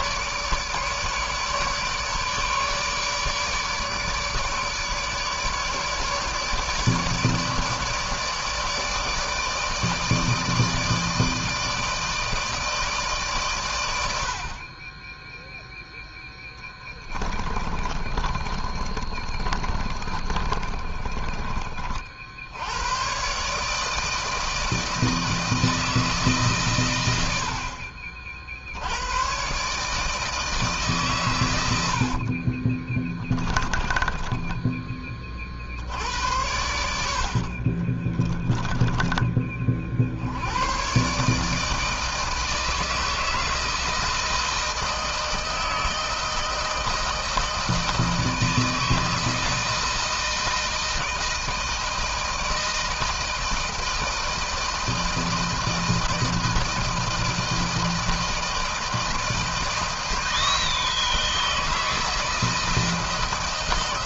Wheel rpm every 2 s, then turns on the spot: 150, 150, 150, 160, 150, 160, 140, 20, 20, 30, 30, 120, 160, 100, 100, 140, 20, 30, 70, 20, 130, 160, 160, 160, 160, 160, 160, 160, 160, 160, 160, 160.
16-22 32-34 36-38